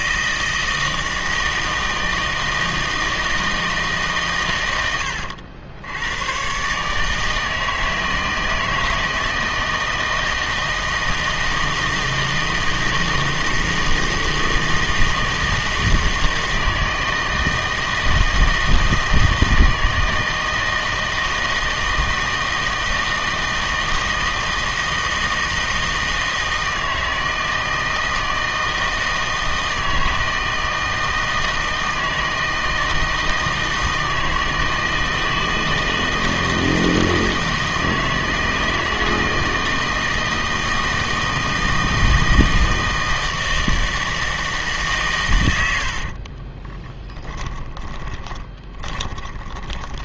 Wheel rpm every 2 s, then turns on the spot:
160, 160, 110, 140, 160, 160, 160, 160, 160, 160, 160, 160, 160, 160, 160, 160, 160, 160, 160, 160, 160, 160, 140, 20, 20.
46-50